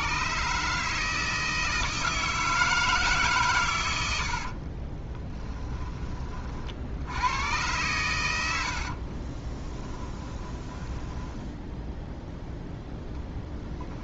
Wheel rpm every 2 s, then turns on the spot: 150, 160, 30, 50, 60, 10, 0.
4-6 8-12